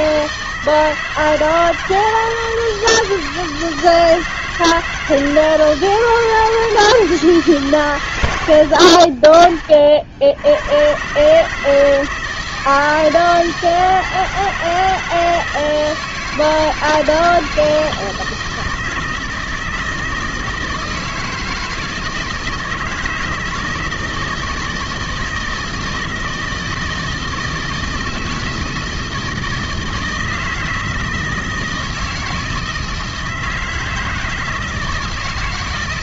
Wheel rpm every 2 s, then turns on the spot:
160, 160, 160, 160, 70, 100, 160, 160, 160, 160, 160, 160, 160, 160, 160, 160, 160, 160.
none